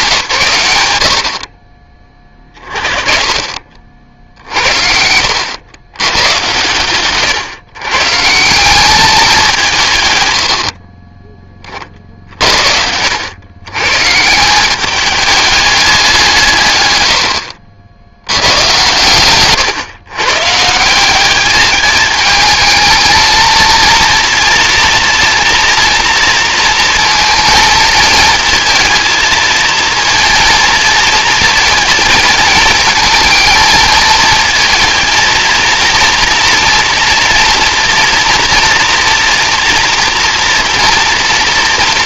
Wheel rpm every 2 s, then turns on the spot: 140, 20, 70, 110, 160, 80, 50, 160, 170, 100, 140, 220, 230, 230, 220, 230, 230, 220, 230, 230, 230.
none